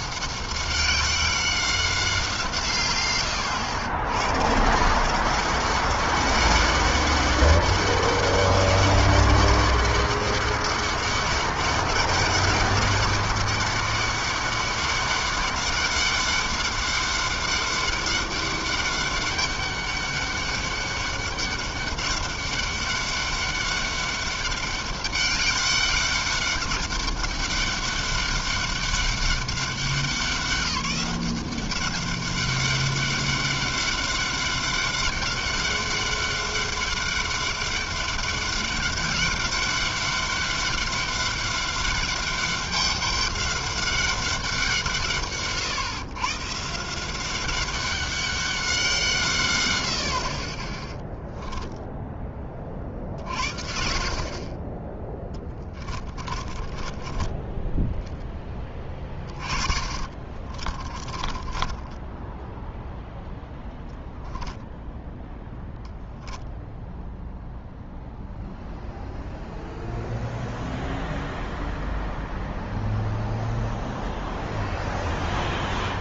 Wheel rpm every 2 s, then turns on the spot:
190, 110, 190, 200, 200, 200, 200, 200, 200, 200, 200, 200, 200, 200, 200, 190, 200, 200, 200, 200, 200, 200, 140, 190, 130, 0, 50, 10, 10, 30, 20, 0, 0, 0, 0, 0, 0, 0.
54-62